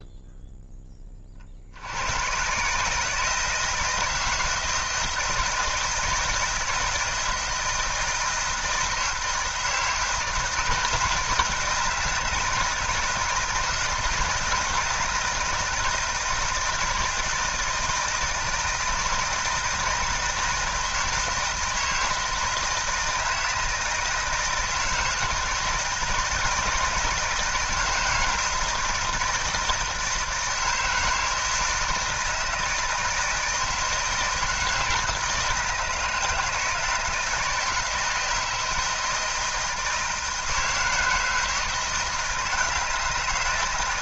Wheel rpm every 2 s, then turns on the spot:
10, 140, 160, 160, 160, 160, 160, 170, 160, 160, 160, 160, 160, 160, 160, 160, 160, 160, 160, 170, 160, 160.
none